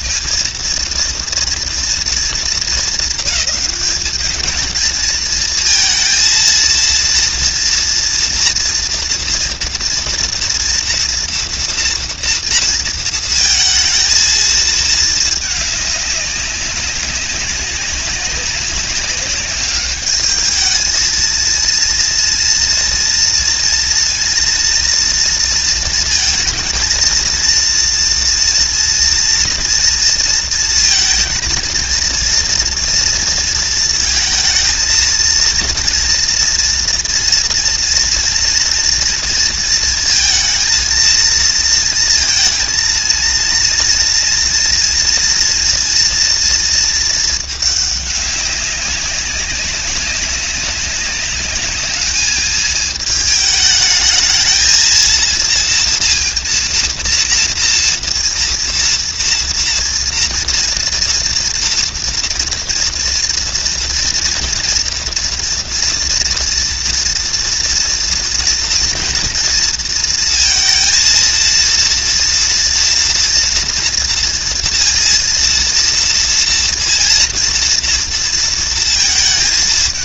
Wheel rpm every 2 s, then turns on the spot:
230, 200, 220, 230, 230, 230, 220, 220, 190, 200, 220, 230, 230, 230, 230, 230, 230, 230, 230, 230, 220, 230, 240, 220, 190, 200, 220, 230, 230, 230, 230, 230, 240, 230, 230, 230, 230, 230, 230, 220.
none